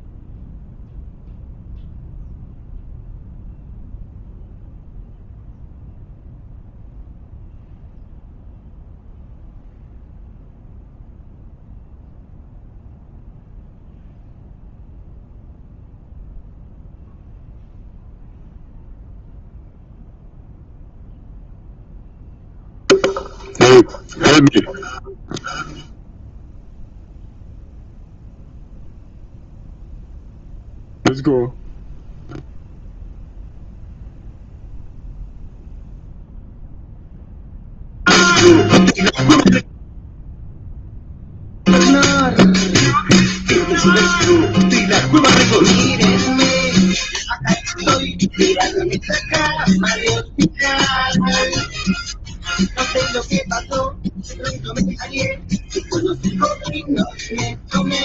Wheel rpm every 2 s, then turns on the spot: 0, 0, 0, 0, 0, 0, 0, 0, 0, 0, 0, 0, 0, 0, 0, 0, 0, 0, 0, 0, 0, 0, 0, 0, 0, 0, 0, 0, 0.
none